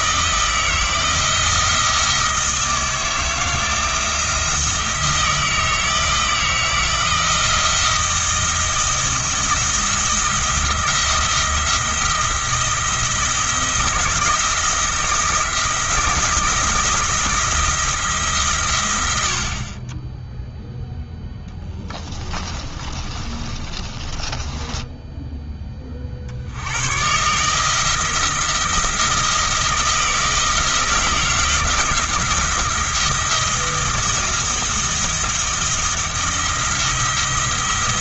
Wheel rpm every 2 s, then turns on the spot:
160, 160, 170, 170, 170, 170, 170, 170, 170, 110, 0, 30, 10, 100, 170, 160, 160, 170, 170.
22-26